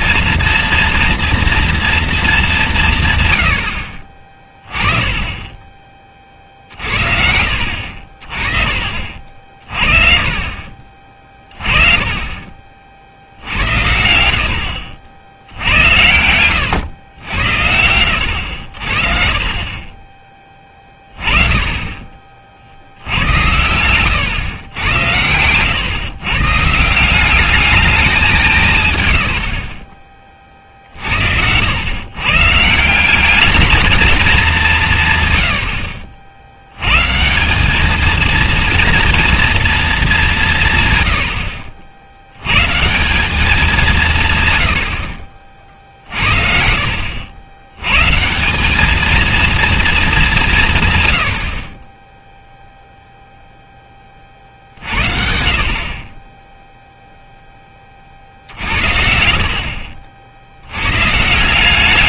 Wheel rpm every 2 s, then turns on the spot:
230, 190, 20, 50, 30, 50, 40, 70, 100, 70, 20, 60, 110, 140, 170, 40, 160, 180, 90, 230, 140, 130, 110, 50, 190, 160, 0, 50, 0, 60, 100.
20-22